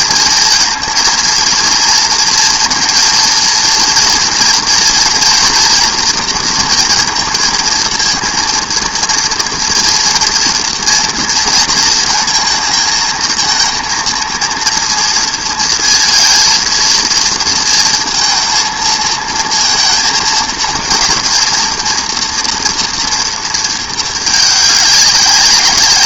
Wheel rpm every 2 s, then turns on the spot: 220, 230, 230, 230, 230, 240, 220, 230, 230, 230, 230, 230, 200.
none